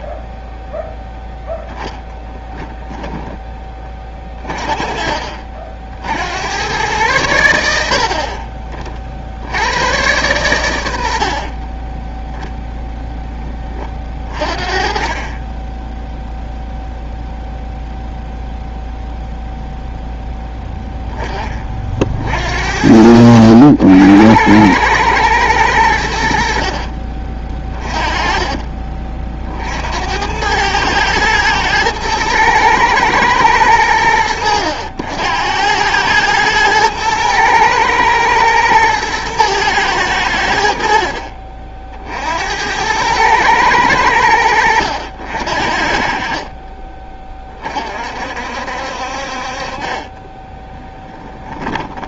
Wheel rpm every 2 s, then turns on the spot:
0, 0, 40, 100, 30, 90, 10, 30, 0, 0, 10, 60, 100, 60, 40, 100, 110, 80, 110, 110, 60, 90, 80, 30, 60, 10.
46-48 50-52